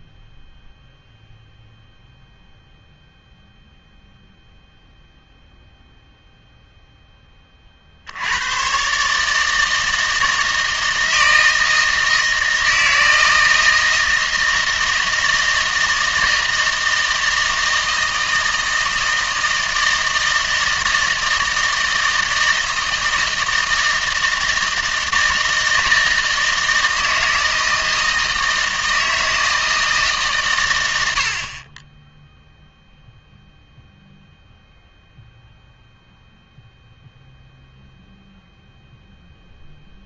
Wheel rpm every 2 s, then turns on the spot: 0, 0, 0, 0, 130, 160, 160, 160, 160, 160, 160, 160, 160, 160, 160, 120, 0, 0, 0, 0.
none